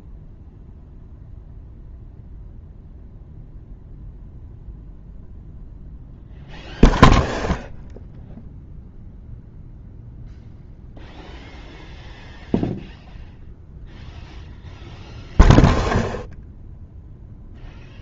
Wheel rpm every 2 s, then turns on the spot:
0, 0, 0, 0, 0, 0, 0, 0, 0.
none